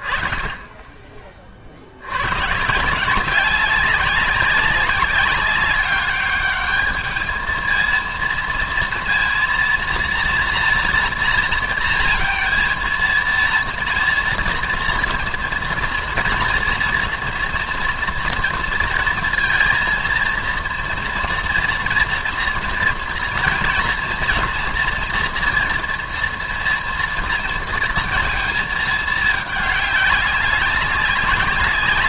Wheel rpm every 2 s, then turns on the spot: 20, 140, 190, 210, 230, 230, 230, 240, 230, 230, 230, 230, 230, 230, 220, 200.
none